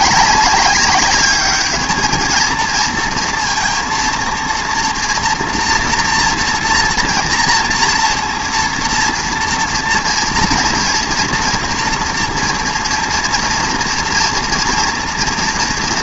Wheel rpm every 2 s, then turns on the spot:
200, 230, 230, 230, 230, 240, 230, 230.
none